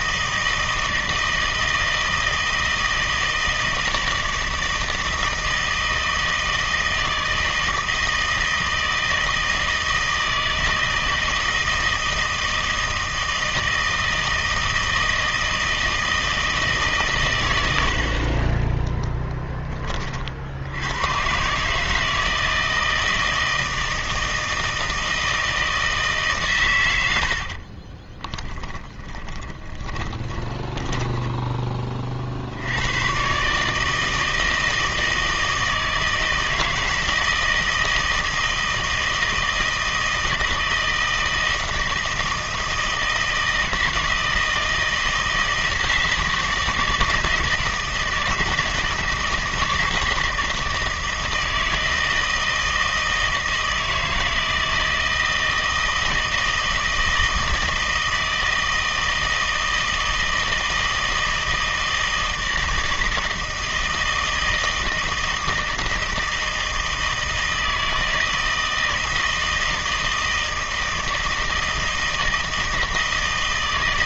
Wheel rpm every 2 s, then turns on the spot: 160, 160, 160, 160, 160, 160, 160, 160, 150, 20, 80, 160, 160, 110, 10, 10, 80, 160, 160, 160, 160, 160, 160, 160, 160, 160, 160, 160, 160, 160, 160, 160, 160, 160, 160, 160, 160.
18-20 28-32